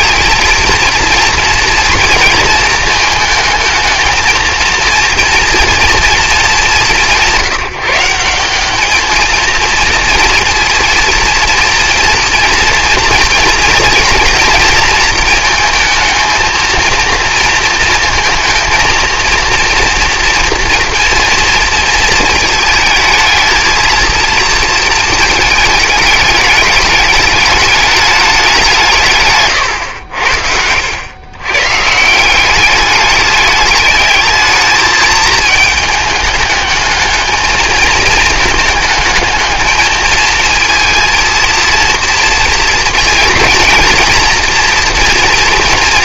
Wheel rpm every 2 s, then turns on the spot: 230, 230, 230, 220, 190, 230, 230, 240, 230, 230, 230, 230, 230, 210, 190, 80, 190, 220, 210, 220, 220, 230, 230.
none